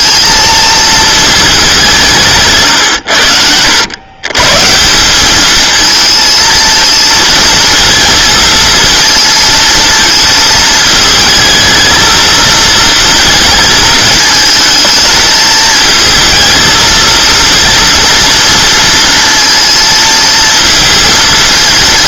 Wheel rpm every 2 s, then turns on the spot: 220, 130, 180, 220, 220, 220, 230, 220, 220, 230, 230.
2-4